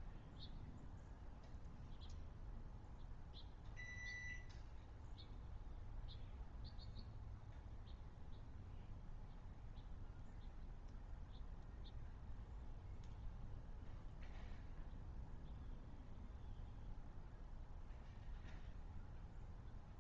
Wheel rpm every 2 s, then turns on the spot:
0, 0, 0, 0, 0, 0, 0, 0, 0, 0.
none